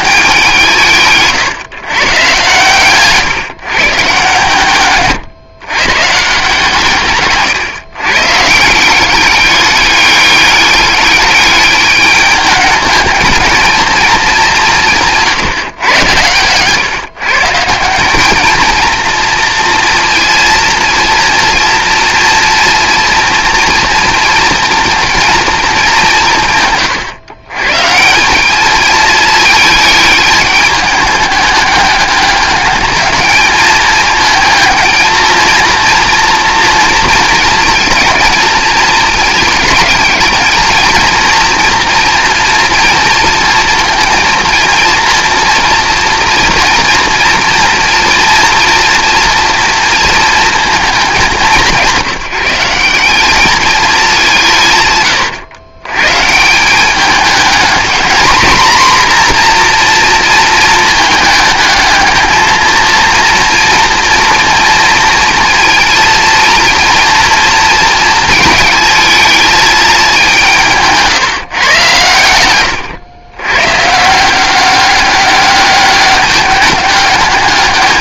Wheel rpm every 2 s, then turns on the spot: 160, 120, 140, 150, 170, 200, 210, 170, 120, 220, 230, 230, 230, 140, 220, 210, 210, 220, 230, 230, 220, 230, 230, 240, 230, 220, 190, 150, 190, 230, 220, 230, 230, 240, 220, 170, 120, 190, 200.
none